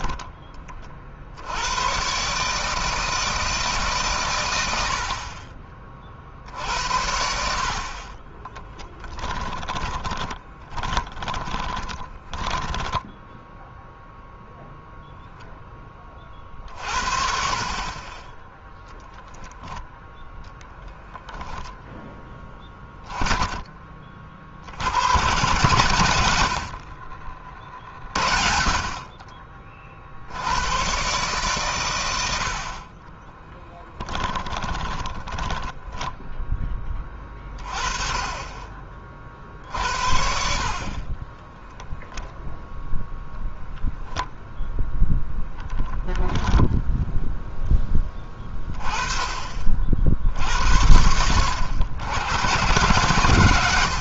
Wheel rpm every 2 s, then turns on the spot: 50, 160, 70, 70, 10, 10, 10, 0, 50, 0, 10, 10, 100, 50, 40, 120, 30, 20, 20, 40, 30, 0, 10, 10, 30, 80, 120.
8-14 20-22 32-36 46-48